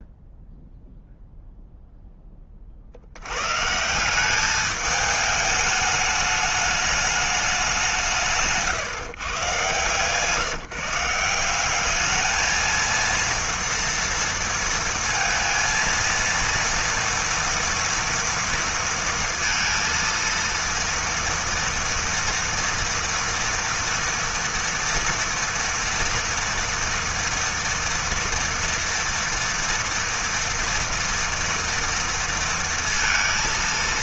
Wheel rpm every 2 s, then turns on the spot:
0, 70, 210, 210, 120, 160, 230, 230, 230, 230, 230, 230, 230, 230, 230, 240, 230.
none